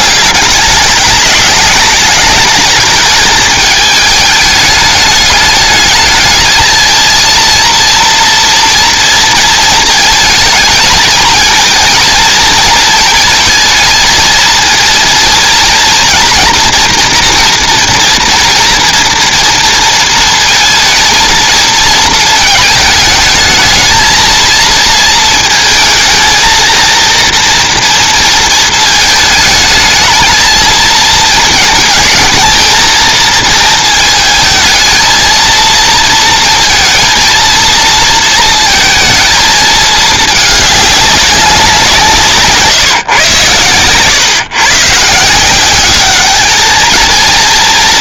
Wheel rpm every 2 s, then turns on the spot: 200, 220, 210, 220, 230, 220, 230, 230, 240, 230, 230, 220, 230, 230, 220, 220, 230, 220, 230, 230, 210, 150, 130, 220.
none